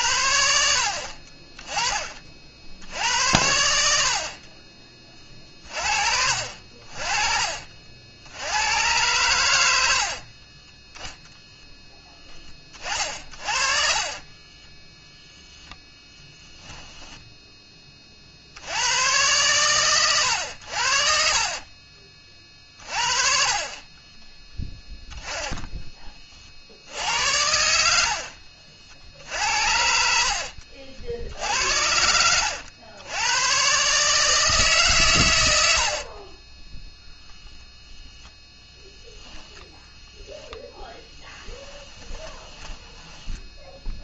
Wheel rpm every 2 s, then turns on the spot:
90, 60, 40, 50, 100, 20, 30, 20, 10, 80, 90, 40, 10, 60, 80, 40, 100, 160, 20, 0, 10, 10.
10-12 14-16 24-26 40-44